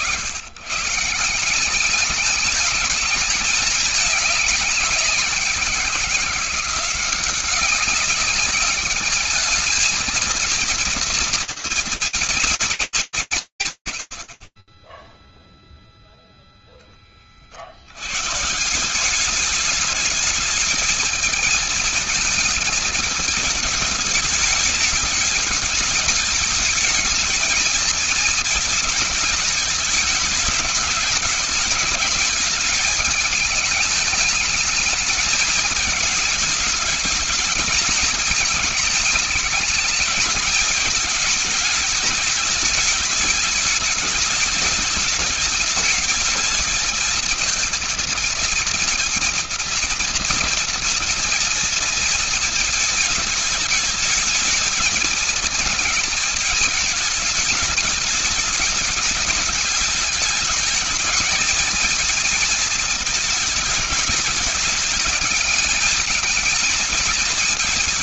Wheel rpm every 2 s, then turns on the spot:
140, 220, 200, 180, 200, 230, 230, 50, 10, 180, 220, 220, 210, 220, 220, 210, 210, 210, 210, 220, 210, 210, 210, 220, 230, 230, 220, 220, 220, 210, 220, 220, 220, 220.
none